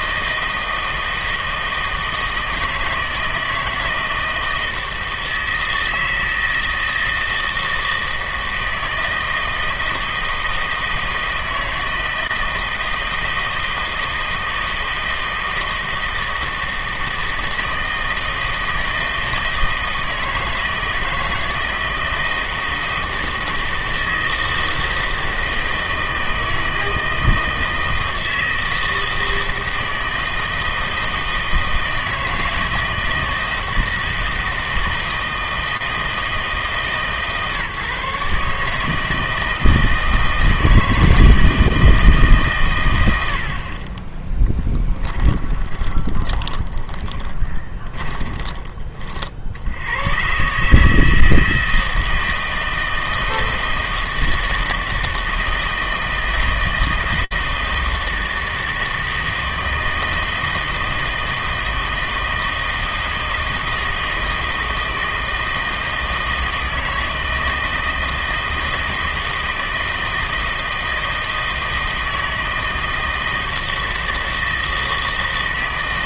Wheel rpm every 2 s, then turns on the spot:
160, 160, 160, 160, 160, 160, 160, 160, 160, 160, 160, 160, 160, 160, 160, 160, 160, 160, 160, 150, 160, 120, 10, 20, 20, 140, 160, 160, 160, 160, 160, 160, 160, 160, 160, 160, 160, 160.
44-50